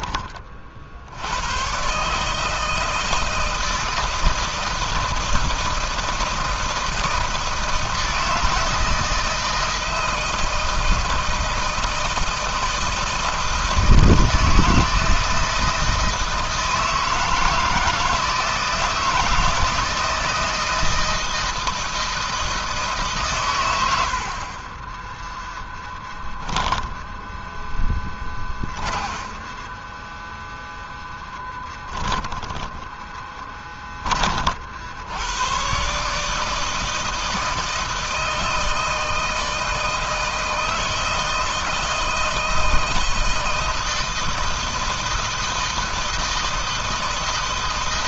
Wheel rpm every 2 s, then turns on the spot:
30, 150, 160, 160, 160, 160, 160, 160, 160, 160, 160, 160, 40, 10, 20, 10, 20, 50, 160, 160, 160, 160, 160, 160.
26-34